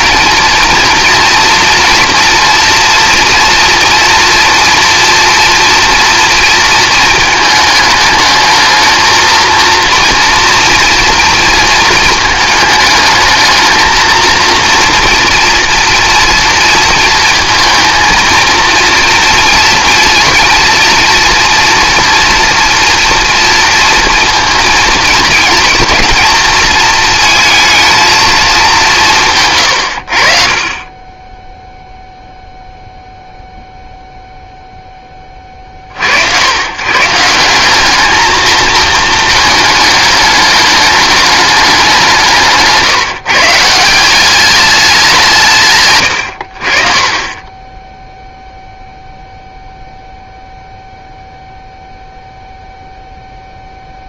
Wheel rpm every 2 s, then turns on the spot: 230, 230, 240, 230, 220, 230, 220, 230, 230, 230, 230, 230, 220, 230, 200, 40, 0, 0, 120, 220, 210, 150, 200, 60, 0, 0, 0.
none